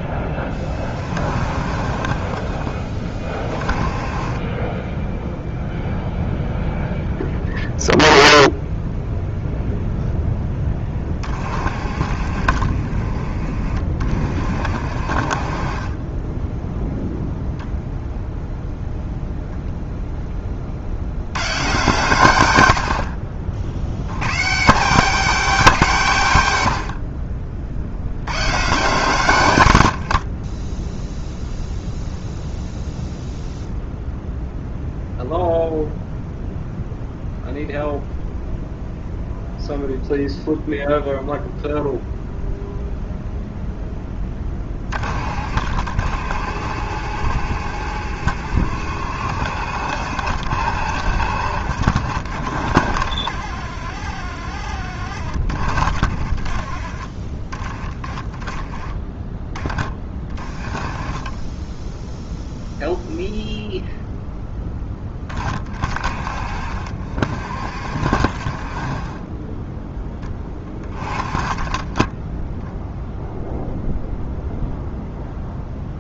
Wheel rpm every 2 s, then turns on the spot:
30, 20, 10, 0, 0, 20, 40, 50, 0, 0, 60, 70, 180, 70, 140, 10, 0, 0, 0, 0, 0, 0, 30, 70, 70, 60, 50, 50, 30, 20, 20, 0, 10, 50, 30, 20, 0, 0.
54-56